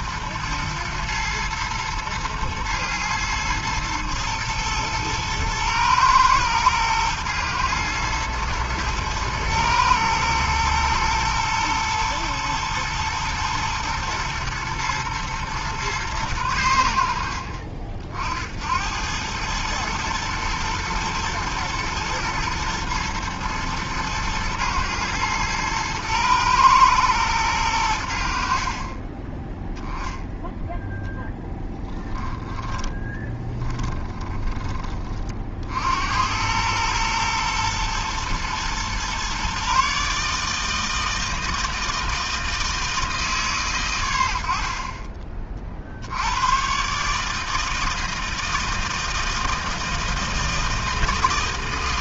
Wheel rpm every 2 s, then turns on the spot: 110, 110, 110, 110, 110, 110, 110, 110, 100, 80, 120, 120, 110, 110, 50, 0, 10, 20, 100, 120, 160, 160, 60, 120, 160, 160.
none